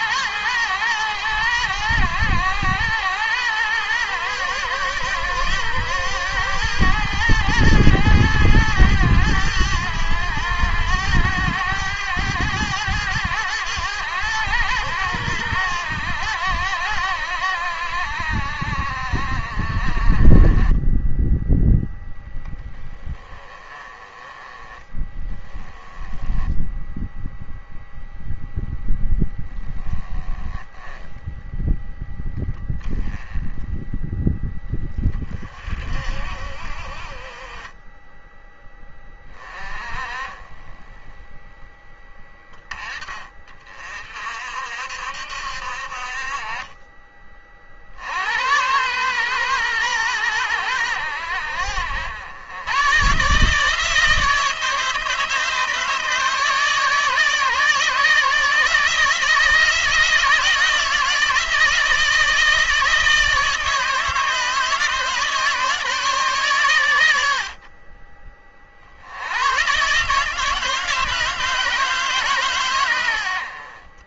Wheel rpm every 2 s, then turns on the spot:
110, 90, 110, 110, 110, 100, 100, 100, 90, 60, 30, 10, 20, 10, 0, 10, 10, 20, 50, 20, 20, 10, 60, 40, 100, 100, 110, 160, 150, 160, 160, 160, 150, 130, 40, 150, 130.
none